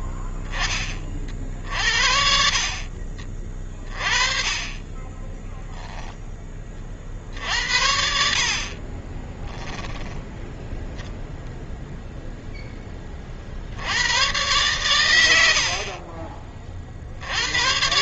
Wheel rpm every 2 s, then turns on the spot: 20, 50, 20, 30, 30, 0, 10, 120, 40.
8-10